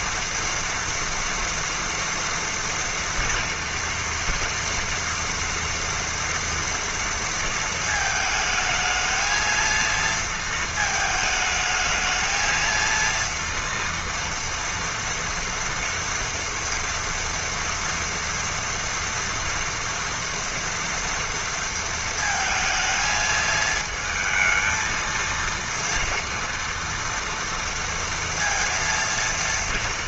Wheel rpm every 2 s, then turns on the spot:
240, 230, 230, 230, 220, 220, 230, 230, 230, 230, 230, 220, 230, 230, 230.
none